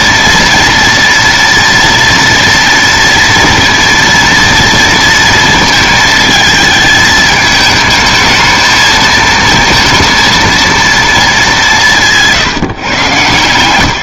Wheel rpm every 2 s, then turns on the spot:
230, 230, 230, 220, 220, 220, 120.
none